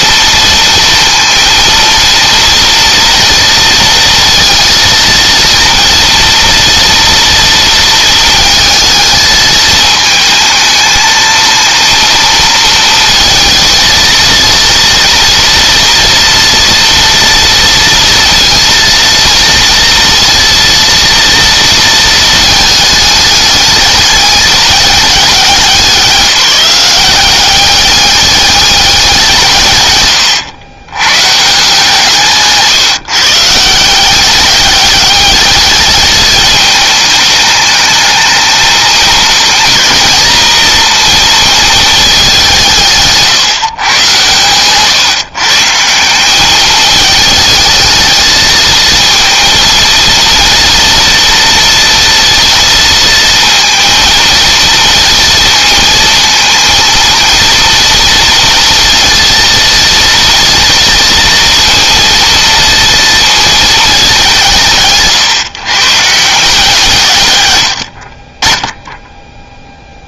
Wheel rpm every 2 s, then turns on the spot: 230, 240, 230, 230, 220, 220, 230, 230, 230, 230, 230, 220, 200, 190, 200, 100, 160, 200, 210, 220, 230, 180, 130, 200, 220, 230, 230, 230, 230, 230, 230, 230, 170, 150, 20.
none